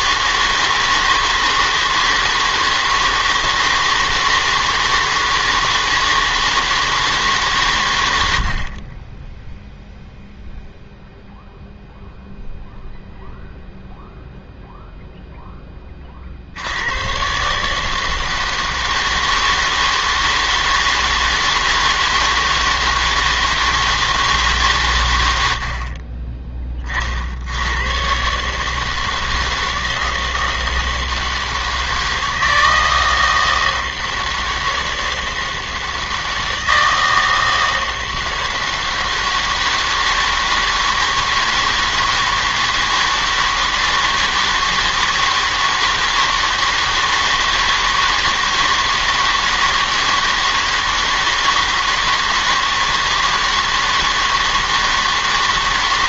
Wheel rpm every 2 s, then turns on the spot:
160, 160, 160, 160, 60, 0, 0, 0, 70, 160, 160, 160, 150, 30, 150, 160, 160, 160, 160, 160, 160, 160, 160, 160, 160, 160, 160, 160.
none